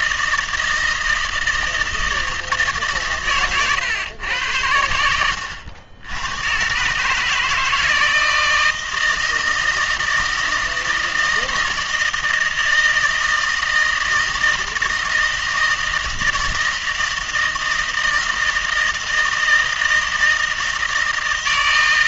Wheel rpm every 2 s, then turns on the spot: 160, 150, 90, 130, 160, 160, 160, 160, 160, 160, 160.
none